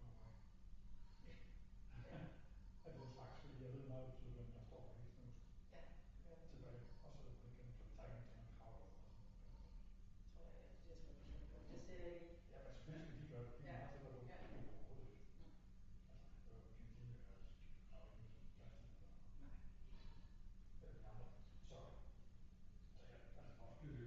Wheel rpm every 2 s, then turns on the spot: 0, 0, 0, 0, 0, 0, 0, 0, 0, 0, 0, 0.
none